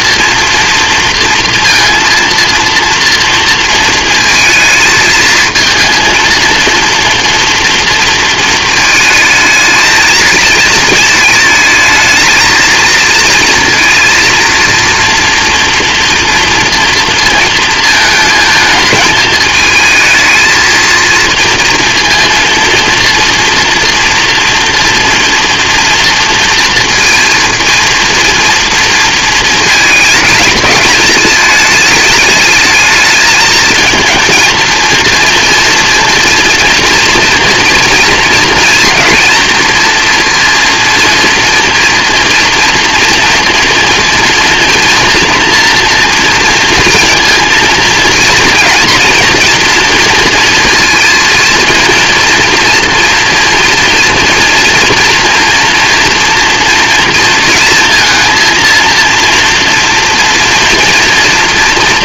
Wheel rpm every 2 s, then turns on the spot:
230, 230, 220, 230, 230, 220, 220, 230, 230, 220, 220, 230, 230, 230, 230, 220, 210, 230, 230, 230, 240, 230, 230, 230, 230, 230, 230, 230, 230, 230, 230.
none